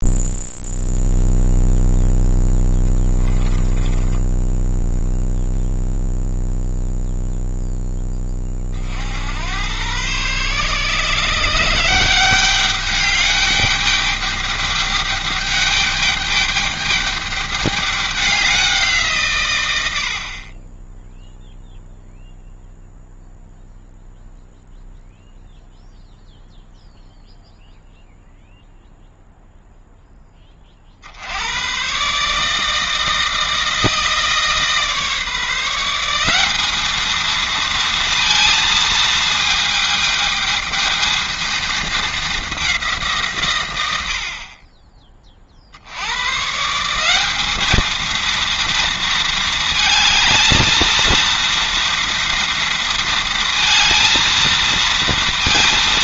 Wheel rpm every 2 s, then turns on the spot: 0, 20, 0, 0, 50, 140, 200, 210, 210, 170, 10, 0, 0, 0, 0, 50, 160, 150, 210, 230, 220, 190, 30, 170, 230, 230, 230, 230.
2-4